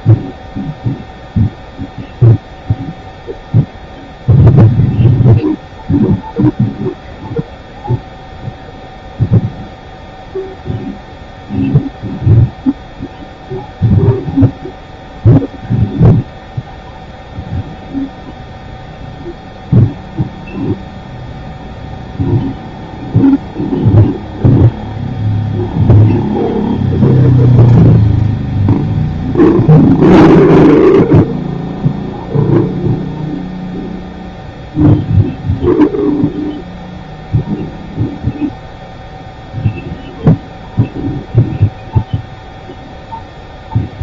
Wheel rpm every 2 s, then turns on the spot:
0, 0, 0, 0, 0, 0, 0, 0, 0, 0, 0, 0, 0, 0, 0, 0, 0, 0, 0, 0, 0, 0.
none